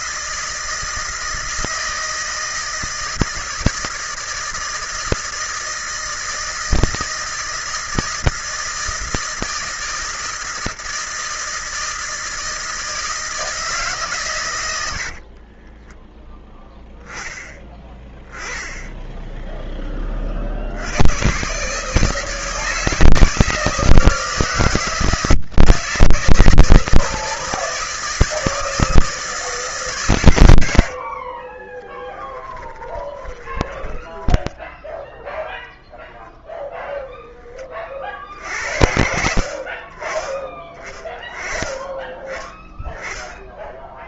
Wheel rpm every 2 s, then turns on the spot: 160, 160, 160, 160, 160, 160, 160, 100, 10, 10, 70, 160, 160, 160, 160, 80, 20, 10, 0, 60, 20, 20.
14-16 30-36